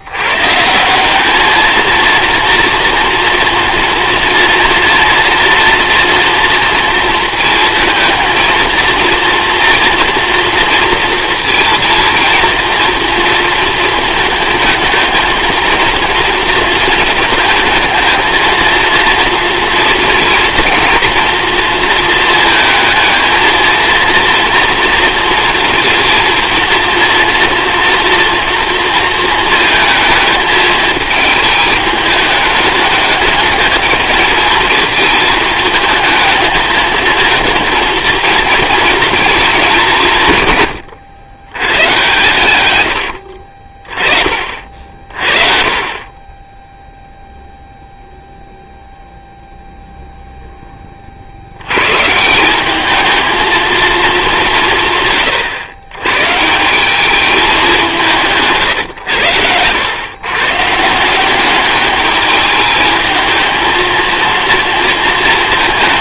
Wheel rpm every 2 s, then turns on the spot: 160, 230, 230, 230, 220, 230, 230, 220, 220, 220, 230, 220, 230, 230, 230, 220, 210, 220, 220, 230, 110, 100, 40, 0, 0, 20, 200, 170, 180, 130, 150, 220, 230.
42-44 58-60